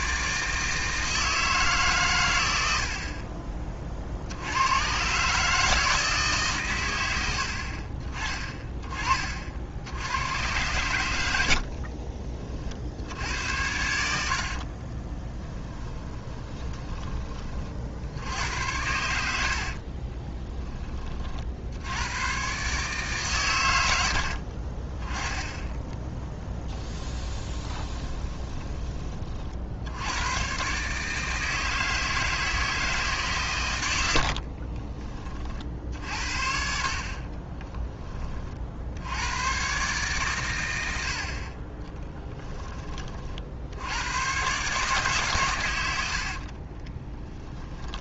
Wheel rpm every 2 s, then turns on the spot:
160, 70, 120, 110, 20, 100, 60, 30, 20, 90, 30, 140, 40, 10, 20, 130, 160, 40, 50, 60, 80, 20, 140, 20.
14-16 26-28 34-36 46-48